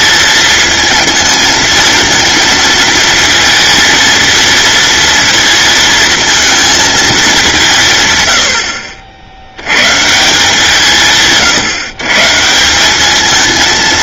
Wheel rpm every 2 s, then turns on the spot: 220, 220, 230, 220, 70, 150, 190.
none